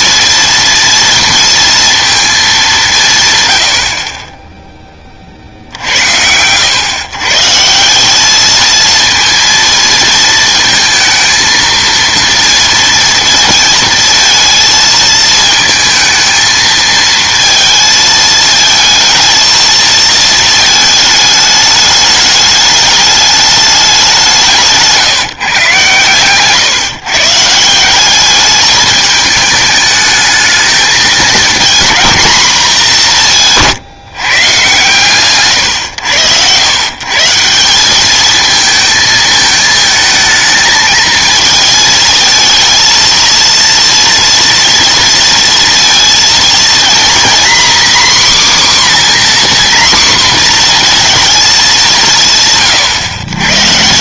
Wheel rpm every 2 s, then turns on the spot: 230, 190, 20, 120, 230, 230, 230, 230, 220, 230, 220, 210, 160, 140, 220, 220, 190, 120, 120, 220, 220, 230, 230, 230, 270, 230, 130.
24-26